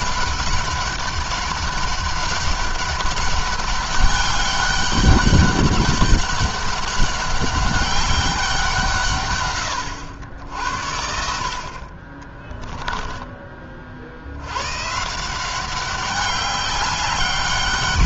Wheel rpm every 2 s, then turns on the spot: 200, 200, 200, 200, 170, 60, 20, 130, 200.
12-14